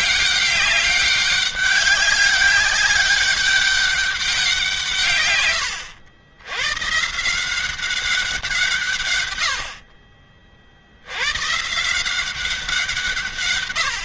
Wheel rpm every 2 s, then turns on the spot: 200, 200, 150, 130, 140, 70, 170.
none